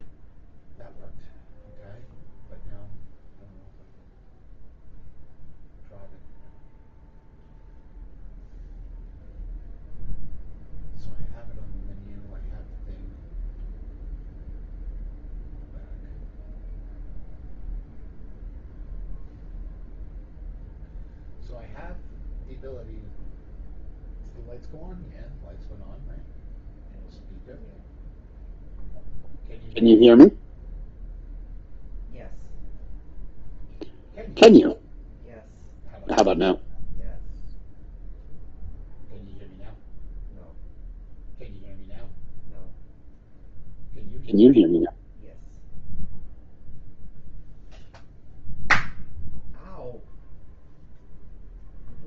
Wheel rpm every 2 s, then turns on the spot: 0, 0, 0, 0, 0, 0, 0, 0, 0, 0, 0, 0, 0, 0, 0, 0, 0, 0, 0, 0, 0, 0, 0, 0, 0, 0.
none